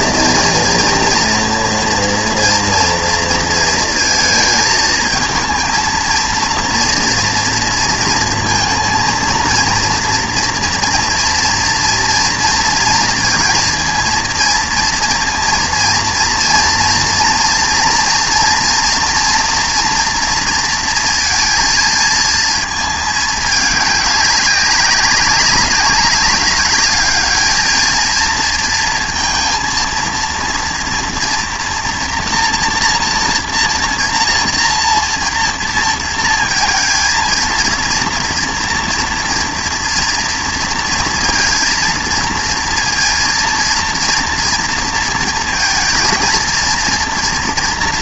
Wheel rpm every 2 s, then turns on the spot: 230, 230, 220, 230, 230, 240, 230, 230, 230, 230, 230, 220, 200, 200, 230, 240, 230, 230, 230, 230, 230, 230, 230, 230.
none